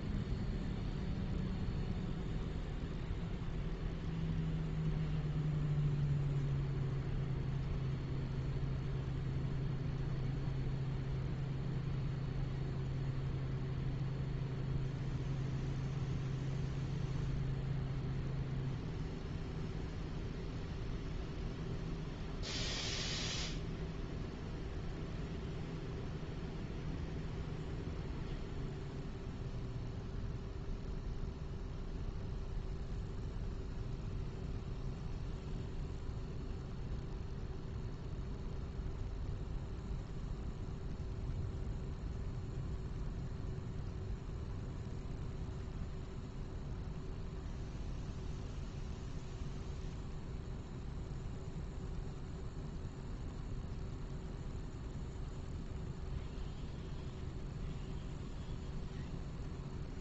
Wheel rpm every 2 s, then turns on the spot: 0, 0, 0, 0, 0, 0, 0, 0, 0, 0, 0, 0, 0, 0, 0, 0, 0, 0, 0, 0, 0, 0, 0, 0, 0, 0, 0, 0, 0, 0.
none